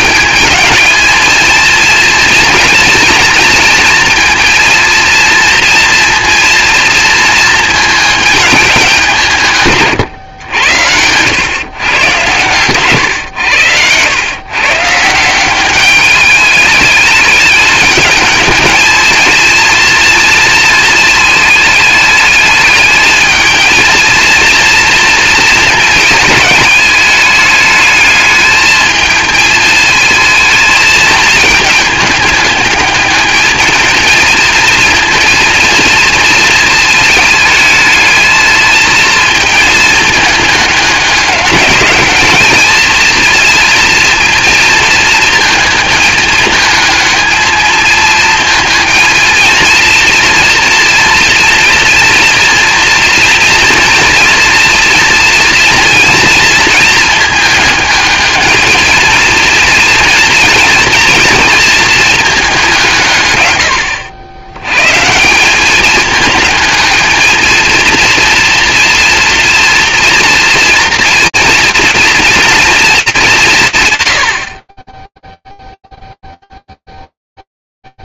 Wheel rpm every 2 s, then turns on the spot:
220, 230, 230, 230, 200, 100, 120, 130, 210, 220, 230, 210, 230, 220, 220, 220, 210, 230, 230, 230, 210, 220, 230, 220, 220, 240, 230, 230, 230, 220, 230, 190, 120, 220, 230, 240, 220, 30, 0.
none